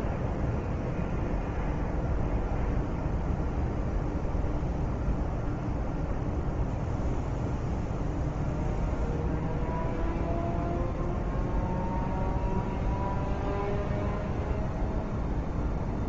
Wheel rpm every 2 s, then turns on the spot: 0, 0, 0, 0, 0, 0, 0, 0.
none